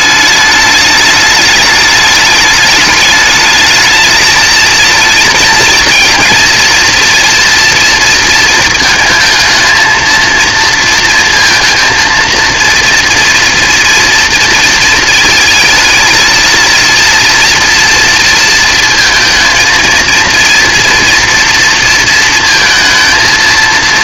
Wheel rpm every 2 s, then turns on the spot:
210, 210, 220, 230, 230, 230, 230, 230, 230, 230, 230, 230.
none